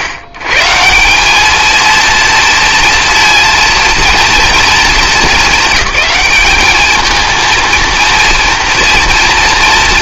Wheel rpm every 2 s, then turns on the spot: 130, 230, 220, 210, 230.
none